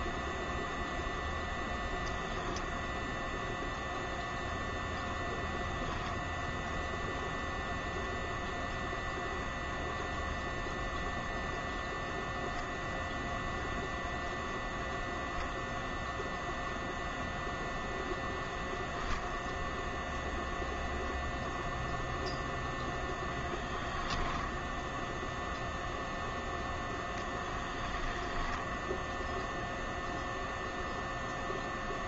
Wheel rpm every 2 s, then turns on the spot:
0, 0, 0, 0, 0, 0, 0, 0, 0, 0, 0, 0, 0, 0, 0, 0.
none